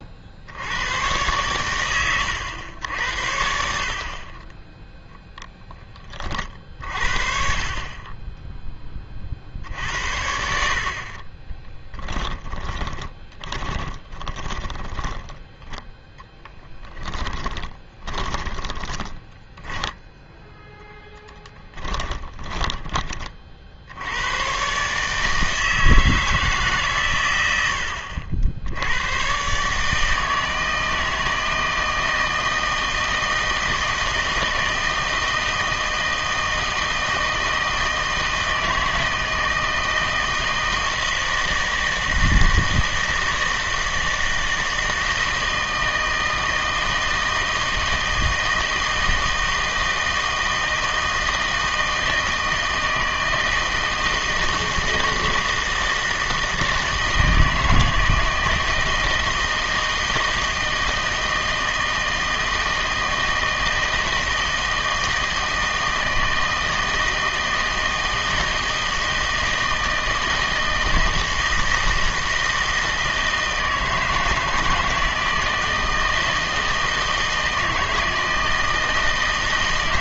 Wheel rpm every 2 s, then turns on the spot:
90, 90, 10, 50, 10, 60, 20, 20, 10, 20, 0, 20, 130, 150, 80, 160, 160, 160, 160, 160, 160, 160, 160, 160, 160, 160, 160, 160, 160, 160, 160, 160, 160, 160, 160, 160, 160, 160, 160, 160.
12-20